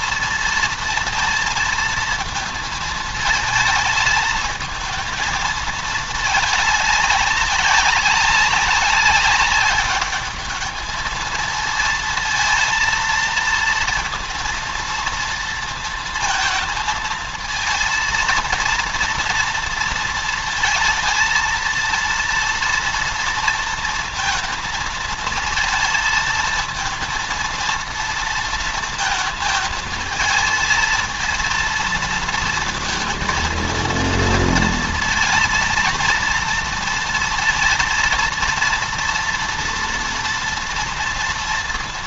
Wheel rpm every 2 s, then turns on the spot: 230, 220, 220, 200, 190, 220, 230, 230, 220, 230, 230, 230, 230, 230, 230, 230, 230, 230, 230, 230, 230.
none